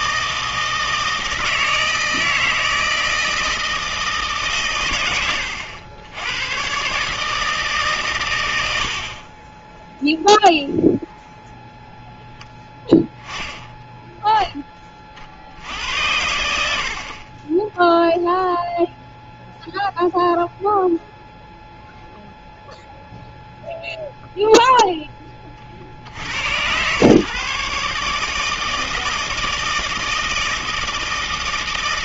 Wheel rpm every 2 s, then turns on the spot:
160, 160, 110, 130, 70, 0, 10, 10, 70, 0, 0, 0, 0, 100, 160, 160.
none